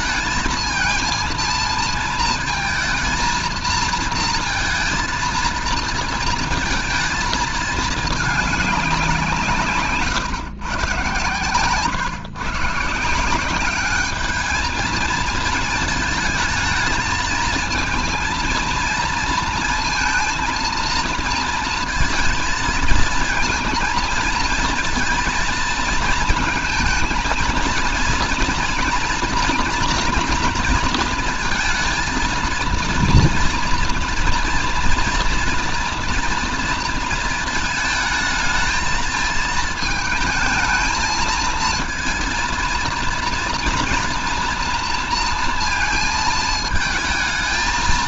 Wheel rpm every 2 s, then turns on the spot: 230, 230, 230, 230, 190, 130, 160, 220, 220, 230, 220, 220, 230, 230, 240, 230, 230, 240, 230, 220, 220, 230, 230, 220.
none